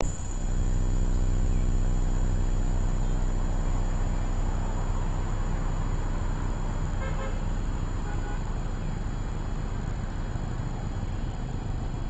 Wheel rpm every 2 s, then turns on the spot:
0, 0, 0, 0, 0, 0.
none